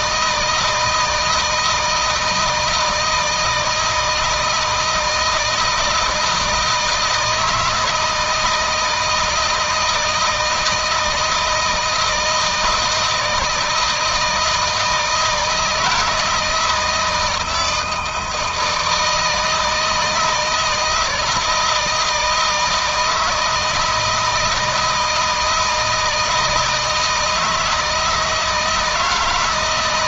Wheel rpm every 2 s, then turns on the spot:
160, 160, 160, 160, 160, 160, 160, 160, 170, 160, 160, 160, 160, 160, 160.
none